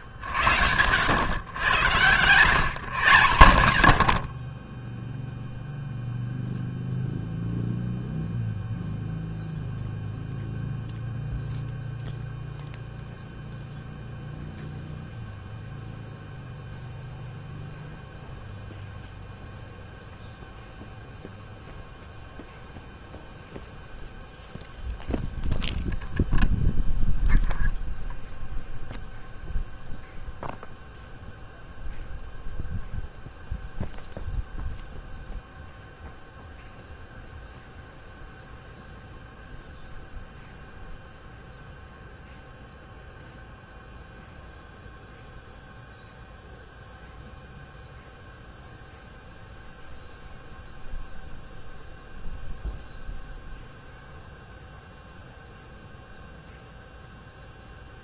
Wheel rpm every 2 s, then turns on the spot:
60, 140, 20, 0, 0, 0, 0, 0, 0, 0, 0, 0, 0, 0, 0, 0, 0, 0, 0, 0, 0, 0, 0, 0, 0, 0, 0, 0, 0.
none